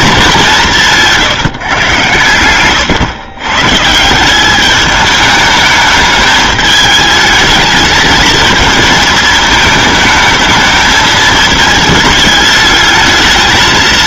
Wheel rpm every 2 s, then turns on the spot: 210, 120, 170, 210, 220, 220, 220.
none